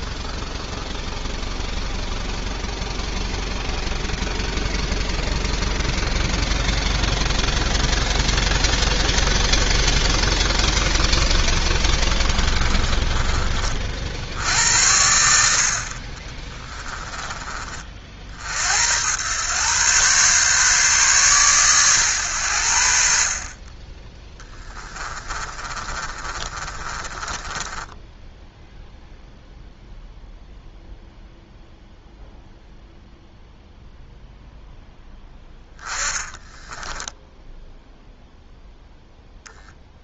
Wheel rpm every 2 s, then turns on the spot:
0, 0, 0, 0, 0, 0, 20, 80, 20, 80, 130, 70, 30, 30, 0, 0, 0, 0, 10, 0.
12-18 24-28 36-38